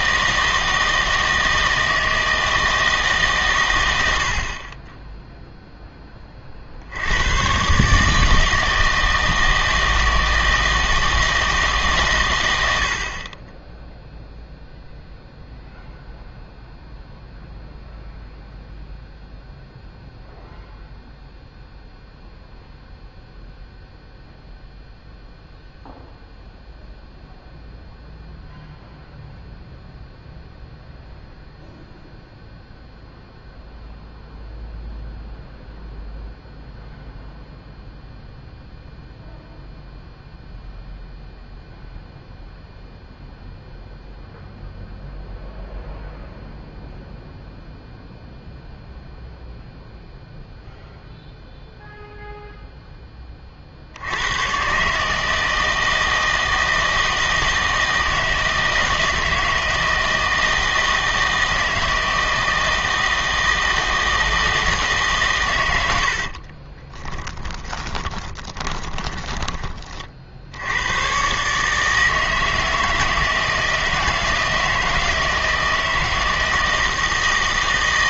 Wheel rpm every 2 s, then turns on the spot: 160, 160, 40, 60, 160, 160, 90, 0, 0, 0, 0, 0, 0, 0, 0, 0, 0, 0, 0, 0, 0, 0, 0, 0, 0, 0, 0, 130, 160, 160, 160, 160, 160, 30, 20, 90, 160, 160, 160.
66-70